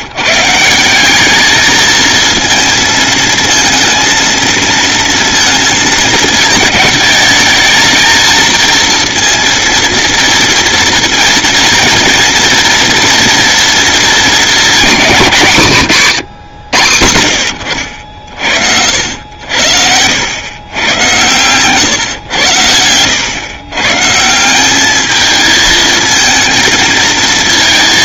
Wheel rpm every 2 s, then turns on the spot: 180, 230, 230, 220, 230, 230, 230, 210, 100, 70, 110, 100, 200, 230.
22-24